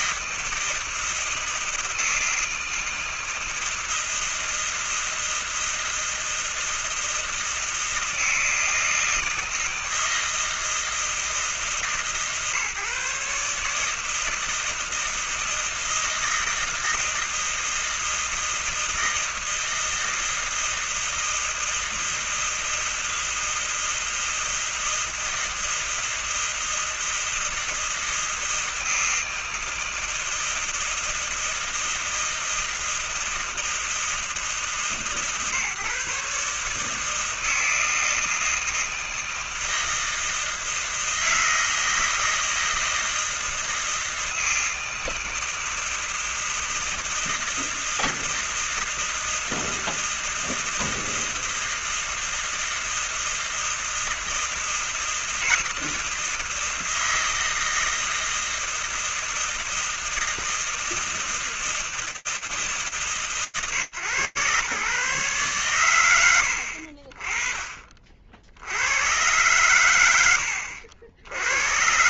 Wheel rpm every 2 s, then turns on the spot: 160, 160, 160, 160, 160, 160, 140, 160, 160, 160, 160, 160, 160, 160, 160, 160, 160, 160, 150, 160, 160, 160, 160, 160, 160, 160, 160, 160, 160, 160, 160, 150, 120, 50, 90, 80.
none